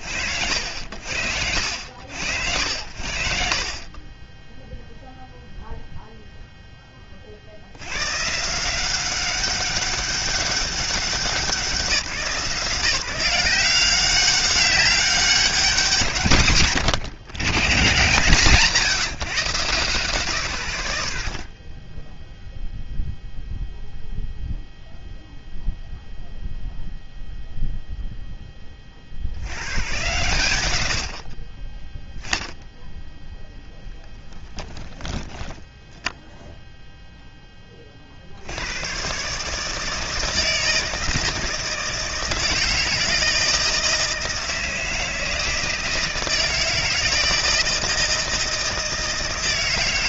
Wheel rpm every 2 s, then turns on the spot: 70, 0, 10, 170, 190, 170, 190, 120, 140, 40, 0, 0, 0, 10, 120, 10, 10, 10, 30, 150, 160, 160, 160, 160, 160.
32-36